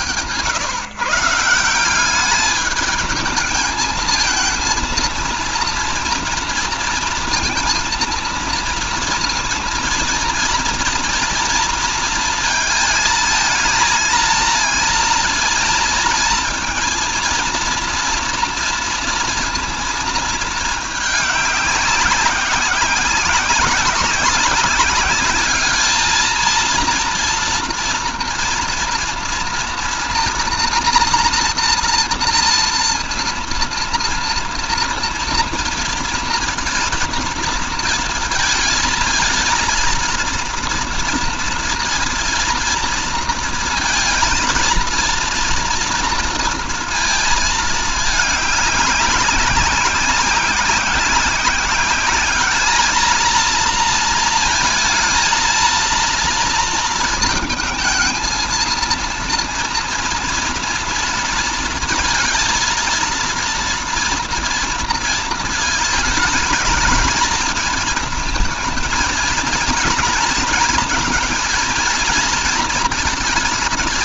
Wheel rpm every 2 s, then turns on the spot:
110, 210, 230, 230, 230, 230, 220, 230, 230, 230, 210, 190, 200, 230, 230, 230, 230, 230, 230, 230, 230, 230, 230, 230, 200, 190, 210, 230, 230, 230, 230, 230, 230, 220, 220, 230, 230.
none